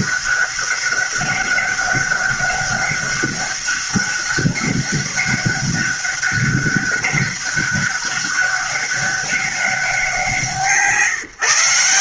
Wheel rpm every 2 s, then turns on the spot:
200, 200, 200, 200, 200, 170.
none